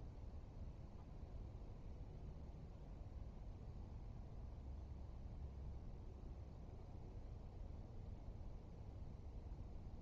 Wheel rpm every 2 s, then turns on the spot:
0, 0, 0, 0, 0.
none